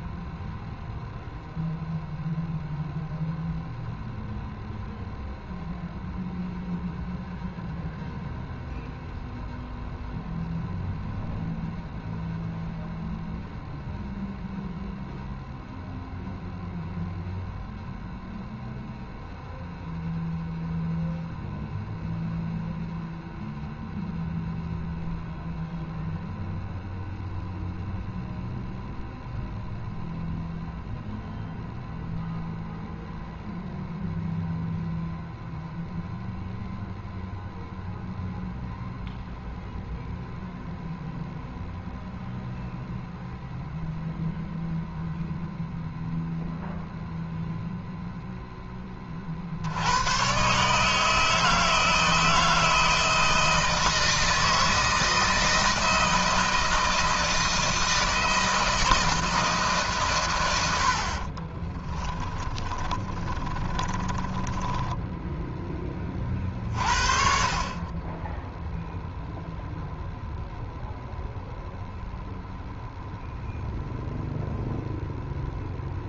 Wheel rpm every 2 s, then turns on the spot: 0, 0, 0, 0, 0, 0, 0, 0, 0, 0, 0, 0, 0, 0, 0, 0, 0, 0, 0, 0, 0, 0, 0, 0, 30, 150, 160, 160, 160, 160, 70, 20, 10, 40, 0, 0, 0, 0.
60-66